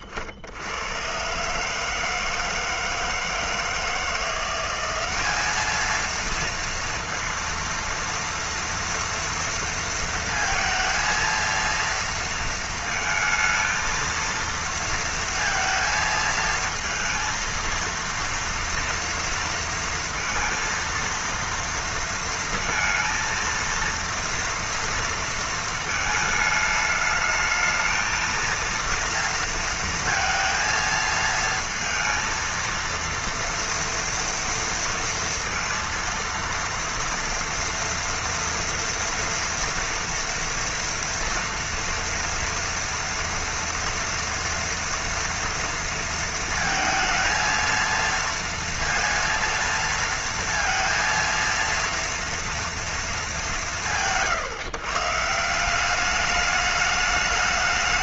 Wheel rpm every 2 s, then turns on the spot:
40, 160, 170, 230, 230, 230, 230, 230, 230, 230, 230, 230, 230, 220, 220, 230, 230, 230, 230, 230, 230, 230, 230, 230, 230, 230, 230, 120, 210.
none